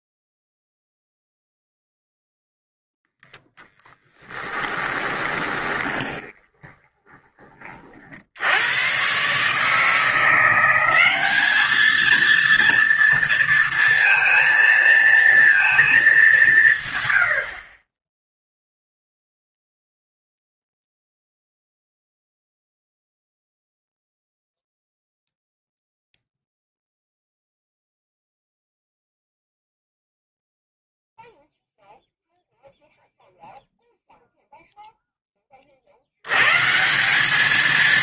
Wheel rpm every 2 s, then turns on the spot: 0, 0, 20, 20, 80, 180, 230, 230, 180, 0, 0, 0, 0, 0, 0, 0, 0, 0, 120.
4-8